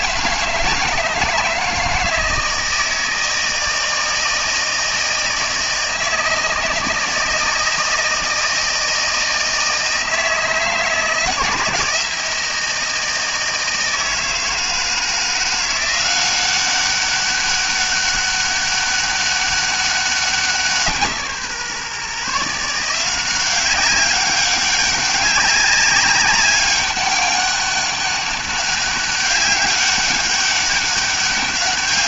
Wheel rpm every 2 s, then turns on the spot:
160, 160, 160, 160, 160, 160, 160, 160, 190, 200, 180, 160, 190, 200, 200, 200.
none